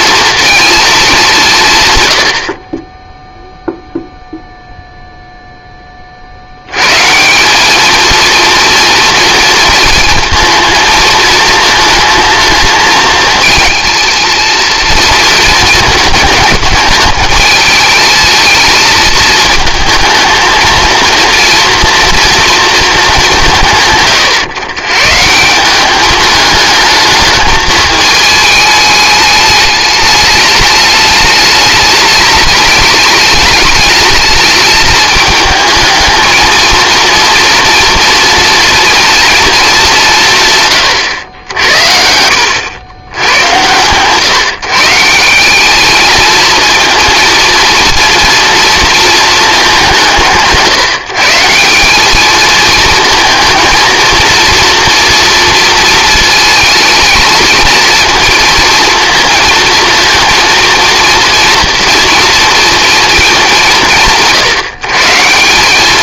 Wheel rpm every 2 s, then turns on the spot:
230, 40, 0, 90, 230, 230, 220, 230, 220, 220, 230, 230, 120, 210, 210, 210, 210, 220, 230, 230, 140, 90, 160, 230, 230, 160, 230, 230, 220, 230, 230, 230, 160.
none